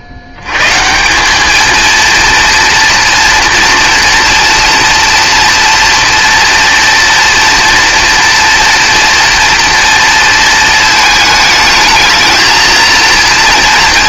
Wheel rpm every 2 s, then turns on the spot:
90, 230, 230, 230, 230, 230, 230.
none